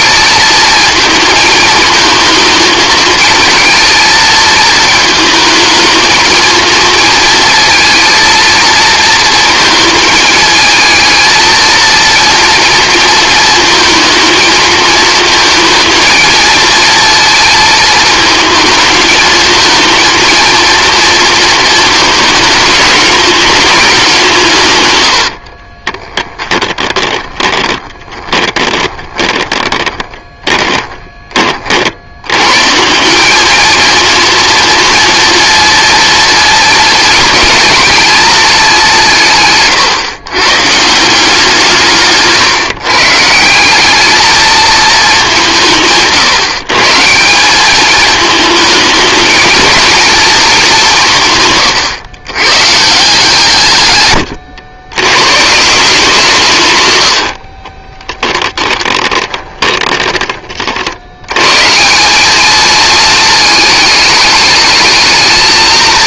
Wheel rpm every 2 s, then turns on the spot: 230, 220, 220, 230, 230, 220, 230, 230, 230, 220, 230, 220, 120, 20, 30, 20, 160, 230, 220, 190, 170, 140, 210, 150, 220, 180, 150, 110, 110, 20, 60, 220, 220.
24-32 56-60